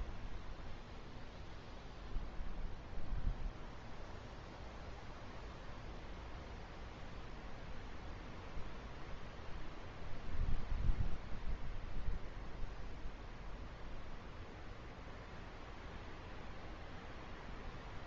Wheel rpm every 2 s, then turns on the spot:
0, 0, 0, 0, 0, 0, 0, 0, 0.
none